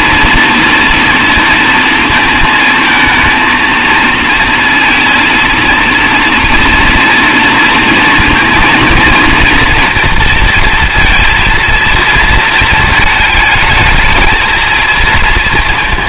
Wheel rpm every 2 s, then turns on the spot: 230, 220, 230, 230, 230, 230, 220, 230.
none